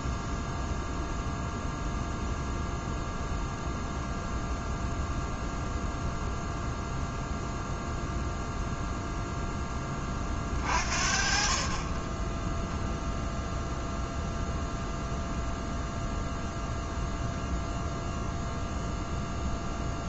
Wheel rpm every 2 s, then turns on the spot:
0, 0, 0, 0, 0, 40, 10, 0, 0, 0.
none